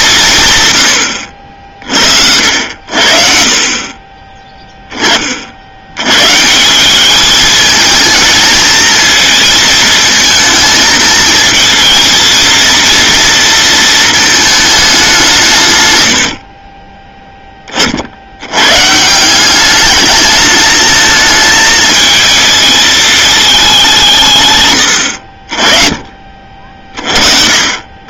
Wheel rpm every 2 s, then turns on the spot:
110, 80, 20, 180, 230, 220, 230, 210, 20, 130, 220, 220, 110, 40.
none